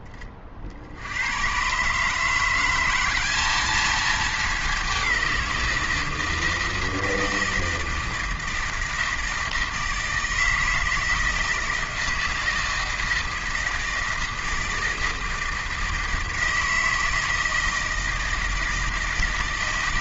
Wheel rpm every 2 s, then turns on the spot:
40, 180, 210, 160, 160, 160, 160, 160, 160, 160.
none